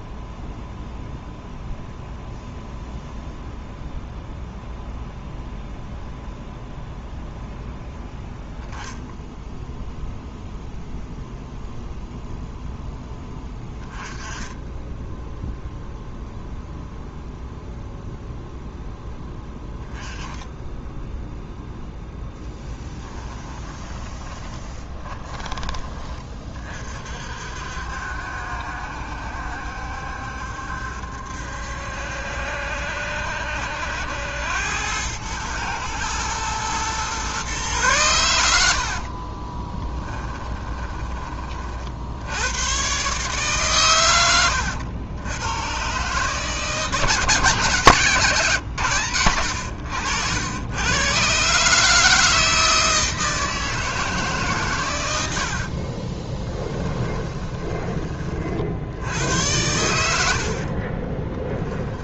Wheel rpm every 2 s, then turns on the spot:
0, 0, 0, 0, 0, 0, 0, 10, 0, 0, 10, 10, 20, 40, 70, 70, 70, 100, 120, 70, 20, 130, 90, 160, 130, 110, 160, 120, 10, 60, 40.
22-26 38-40 56-58 60-62